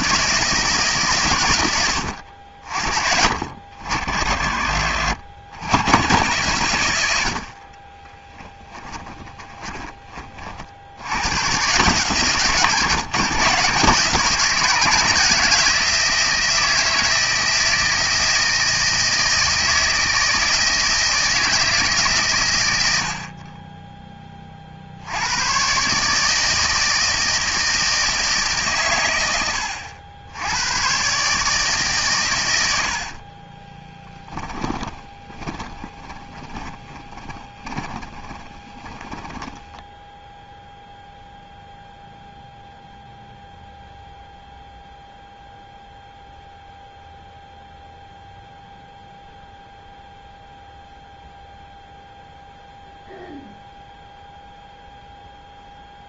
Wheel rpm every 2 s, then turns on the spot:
160, 60, 50, 110, 20, 50, 150, 160, 160, 160, 160, 100, 40, 160, 140, 100, 90, 10, 20, 20, 0, 0, 0, 0, 0, 0, 0, 0.
8-10 34-40